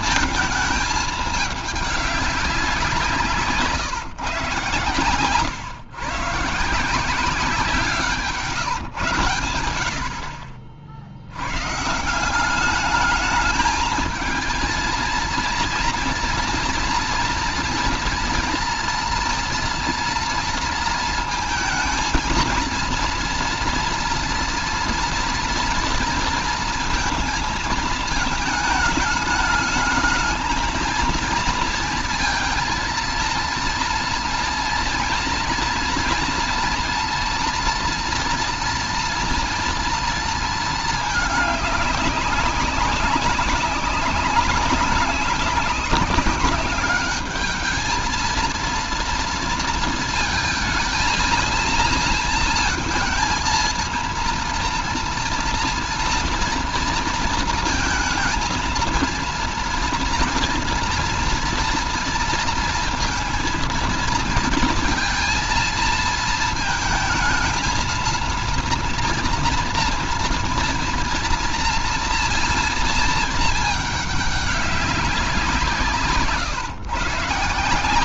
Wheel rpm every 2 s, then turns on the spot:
220, 190, 130, 160, 140, 60, 200, 230, 230, 240, 230, 230, 230, 220, 220, 220, 230, 230, 230, 230, 220, 190, 200, 200, 230, 230, 230, 230, 230, 230, 230, 230, 230, 220, 230, 230, 230, 200, 140.
none